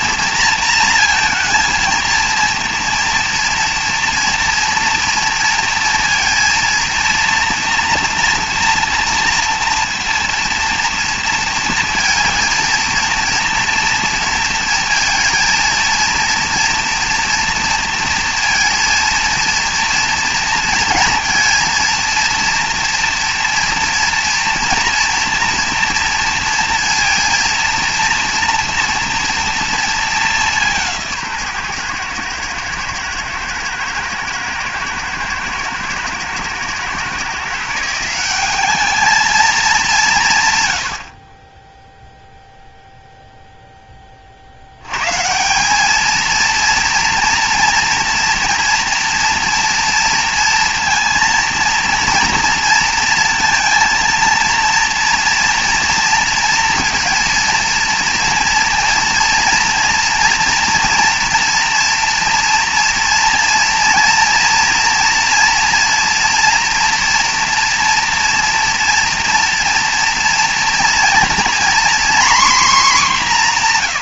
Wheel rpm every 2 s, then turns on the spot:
230, 230, 230, 230, 240, 230, 230, 230, 230, 230, 230, 230, 230, 230, 230, 190, 120, 120, 120, 190, 130, 0, 70, 230, 230, 230, 230, 230, 230, 230, 230, 230, 230, 240, 230, 230, 250.
none